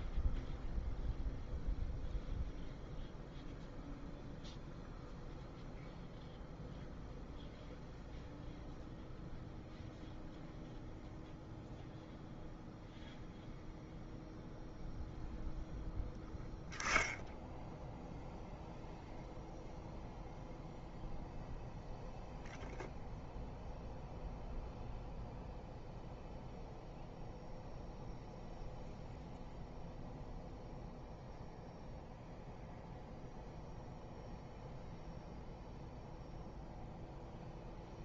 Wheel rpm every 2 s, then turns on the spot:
0, 0, 0, 0, 0, 0, 0, 0, 0, 0, 0, 0, 0, 0, 0, 0, 0, 0, 0.
none